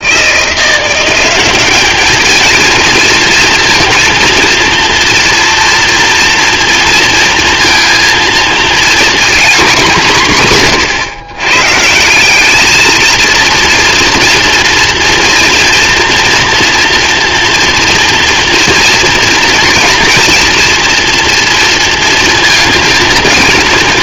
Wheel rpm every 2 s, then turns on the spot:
170, 220, 230, 230, 240, 160, 210, 230, 230, 230, 230, 220.
none